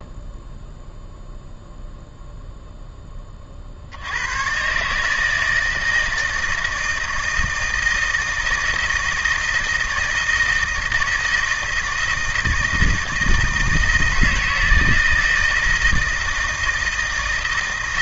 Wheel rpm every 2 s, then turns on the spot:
0, 0, 140, 160, 160, 160, 160, 160, 160.
none